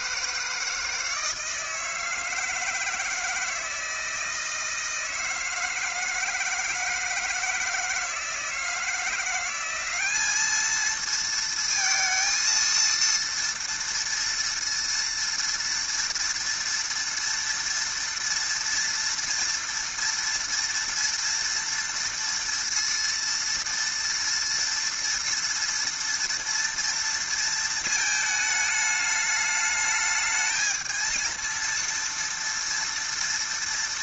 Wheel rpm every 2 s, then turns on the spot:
160, 160, 160, 160, 160, 210, 230, 230, 230, 230, 230, 230, 240, 230, 220, 220, 230.
none